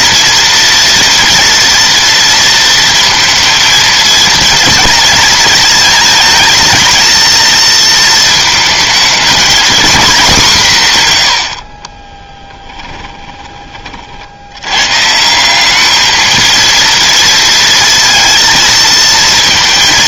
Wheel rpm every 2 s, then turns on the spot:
230, 230, 230, 220, 220, 150, 20, 120, 230, 230.
12-14